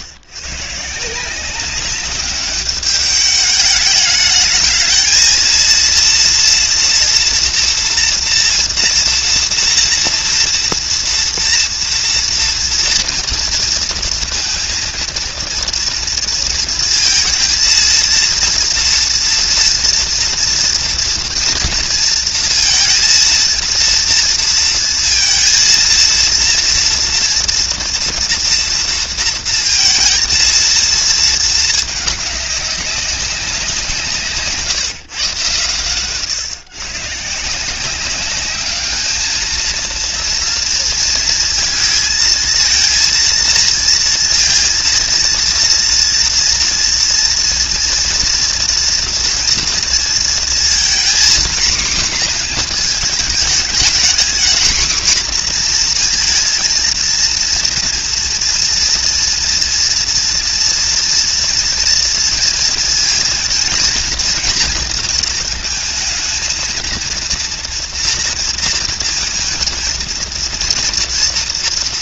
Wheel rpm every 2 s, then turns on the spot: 140, 200, 220, 230, 240, 230, 230, 230, 230, 230, 230, 230, 230, 230, 230, 230, 200, 150, 140, 210, 230, 230, 230, 230, 230, 230, 240, 250, 230, 230, 240, 230, 230, 230, 240, 240.
none